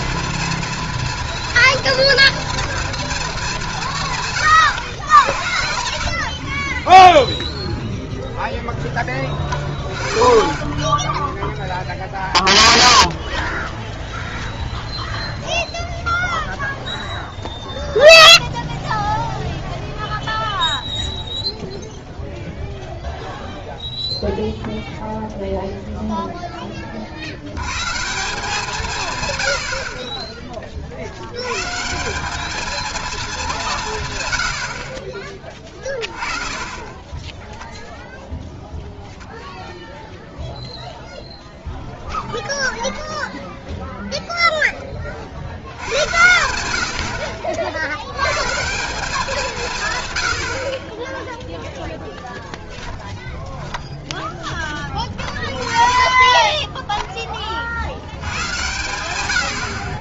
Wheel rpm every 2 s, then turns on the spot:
240, 190, 100, 30, 0, 0, 0, 0, 0, 0, 0, 0, 0, 60, 120, 80, 220, 40, 10, 0, 0, 10, 40, 70, 190, 20, 10, 20, 20, 100.
4-8 36-38 42-44 50-54